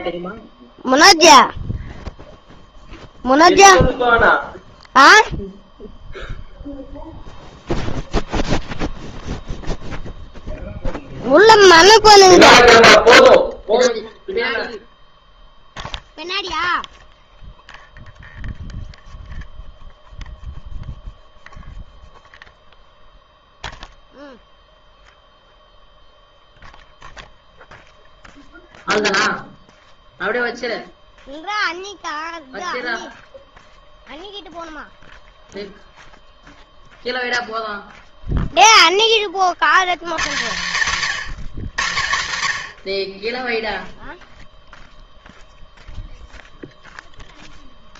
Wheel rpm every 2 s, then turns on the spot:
0, 0, 0, 0, 0, 0, 0, 0, 0, 0, 0, 0, 0, 0, 0, 0, 0, 0, 0, 0, 140, 80, 0, 0.
none